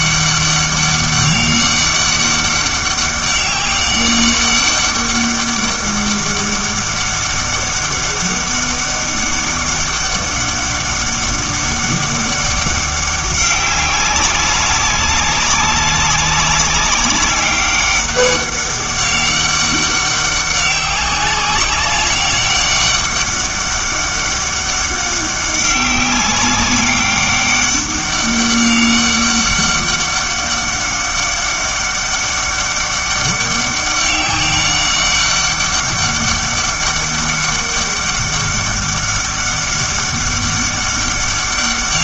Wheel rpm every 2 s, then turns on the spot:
200, 200, 200, 200, 200, 200, 200, 200, 200, 200, 190, 200, 200, 200, 200, 200, 200, 200, 200, 200, 200.
none